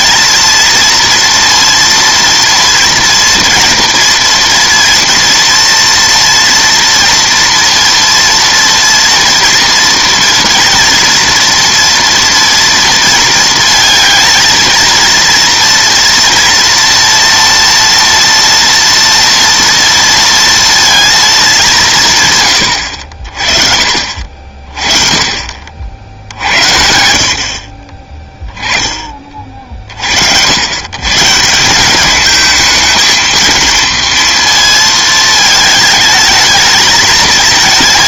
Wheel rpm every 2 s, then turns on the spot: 230, 230, 230, 240, 230, 230, 230, 220, 230, 230, 230, 100, 40, 70, 20, 100, 220, 230, 220.
none